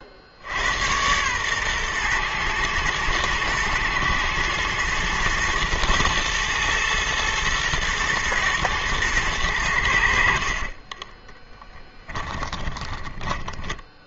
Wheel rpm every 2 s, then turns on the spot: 80, 120, 110, 120, 120, 50, 10.
10-14